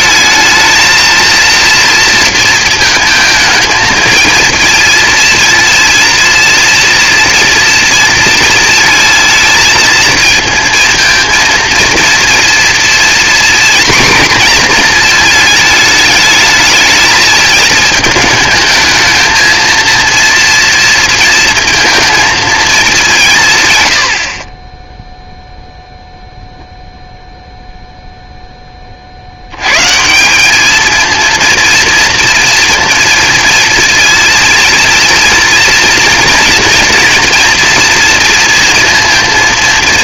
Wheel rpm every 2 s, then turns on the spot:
220, 220, 230, 230, 230, 220, 230, 240, 210, 220, 230, 210, 20, 0, 20, 210, 230, 220, 230, 230.
none